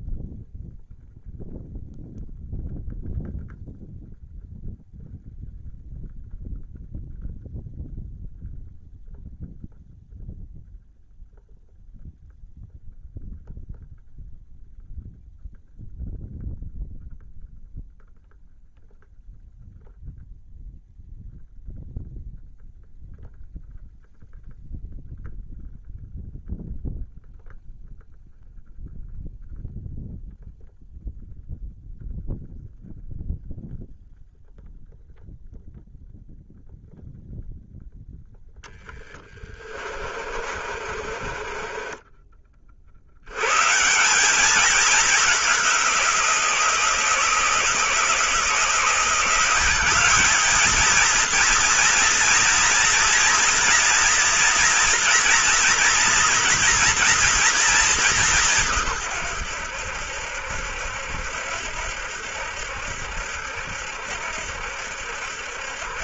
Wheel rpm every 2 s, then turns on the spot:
0, 0, 0, 0, 0, 0, 0, 0, 0, 0, 0, 0, 0, 0, 0, 0, 0, 0, 0, 10, 40, 50, 210, 170, 160, 220, 240, 240, 230, 160, 70, 70, 70.
38-42